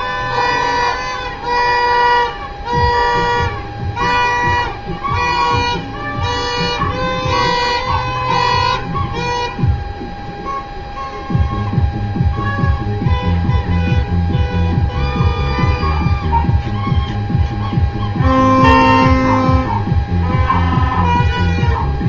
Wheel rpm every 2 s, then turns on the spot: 0, 0, 0, 0, 0, 0, 0, 0, 0, 0, 0.
none